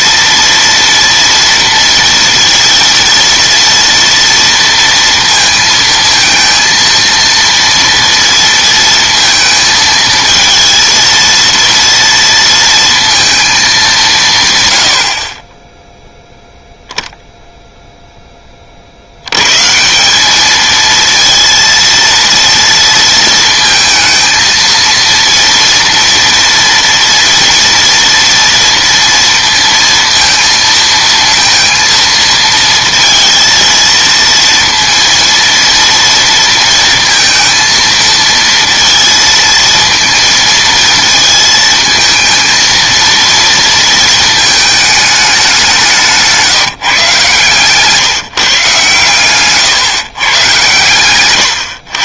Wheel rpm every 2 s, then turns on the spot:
230, 230, 230, 230, 230, 230, 230, 130, 0, 30, 220, 230, 230, 230, 230, 230, 230, 230, 230, 230, 230, 230, 220, 160, 140, 130.
none